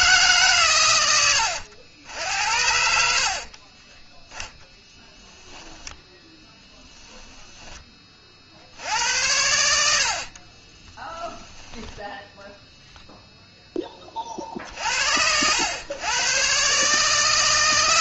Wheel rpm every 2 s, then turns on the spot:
120, 70, 0, 10, 70, 30, 0, 50, 130.
2-4 6-8 10-12